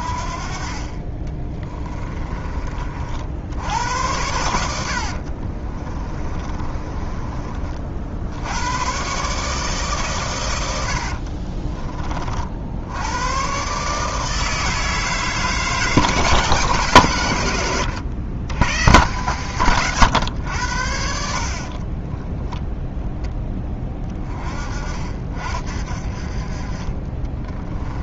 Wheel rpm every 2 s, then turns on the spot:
40, 40, 80, 30, 110, 80, 80, 160, 150, 120, 80, 10, 40, 30.
0-2 4-8 10-12